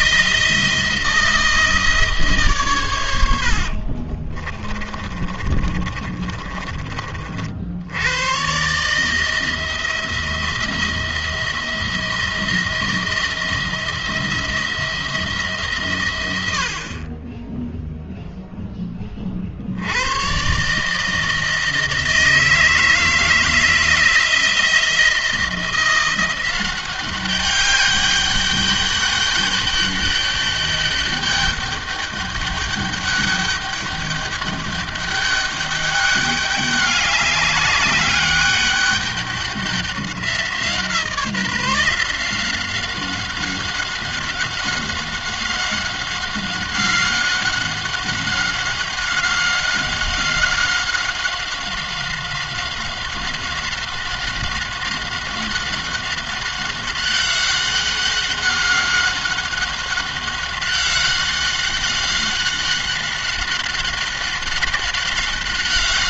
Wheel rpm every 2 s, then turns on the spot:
170, 120, 40, 30, 140, 170, 170, 170, 50, 10, 140, 160, 170, 190, 200, 200, 200, 200, 200, 200, 180, 180, 190, 190, 190, 190, 190, 190, 190, 190, 190, 190, 190.
4-6